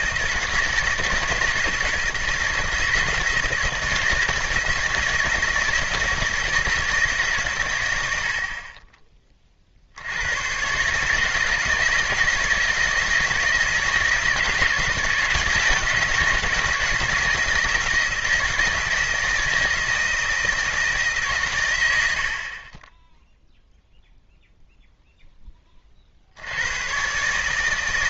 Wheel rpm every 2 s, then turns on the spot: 160, 160, 170, 160, 30, 130, 160, 160, 170, 160, 160, 20, 0, 110.
none